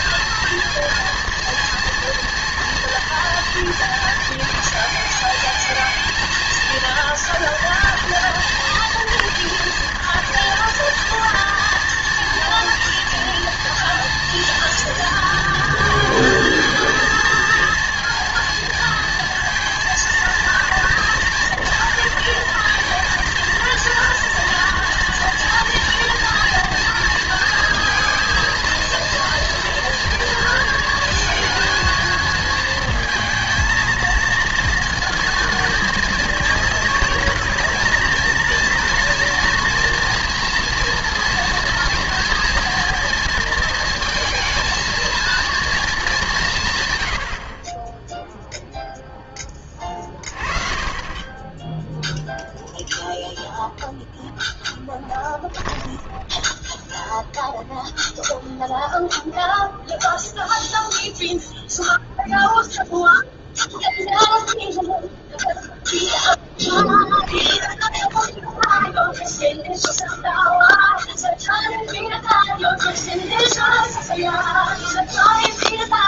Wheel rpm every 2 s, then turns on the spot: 230, 220, 220, 230, 230, 230, 230, 230, 230, 230, 230, 230, 230, 230, 230, 230, 230, 230, 230, 230, 230, 220, 210, 10, 20, 10, 0, 10, 0, 0, 0, 0, 0, 10, 0, 0, 0, 0.
54-56 66-68